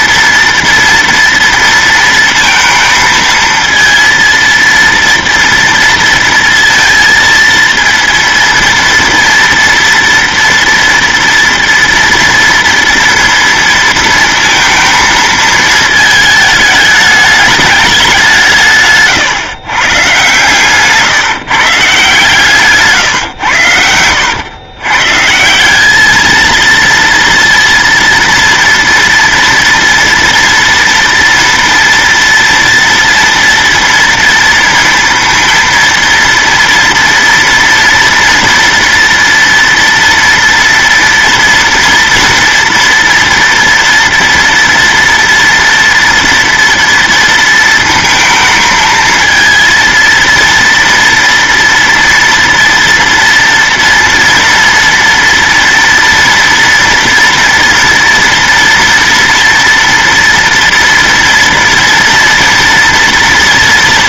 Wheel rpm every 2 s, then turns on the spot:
240, 230, 230, 230, 230, 240, 230, 230, 210, 150, 140, 140, 130, 230, 230, 230, 230, 230, 230, 230, 230, 230, 230, 230, 220, 230, 230, 230, 230, 230, 230, 230.
none